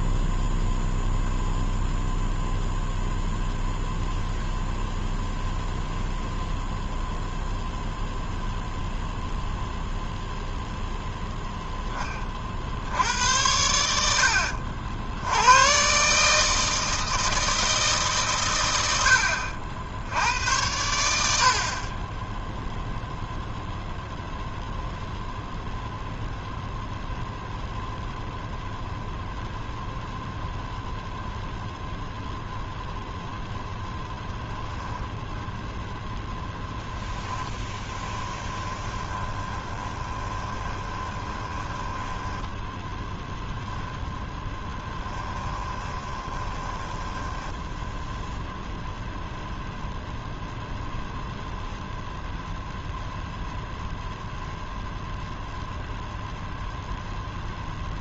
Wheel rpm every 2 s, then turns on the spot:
0, 0, 0, 0, 0, 0, 40, 80, 150, 130, 100, 10, 0, 0, 0, 0, 0, 10, 0, 20, 20, 10, 10, 20, 0, 0, 0, 0, 0.
38-44 46-48